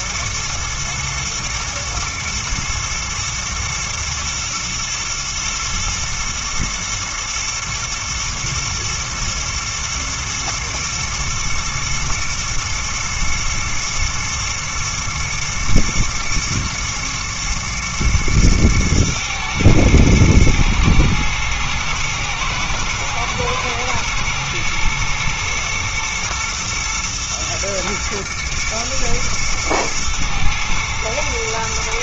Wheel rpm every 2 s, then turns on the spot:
110, 120, 120, 120, 110, 110, 120, 110, 110, 110, 110, 110, 120, 120, 110, 110.
none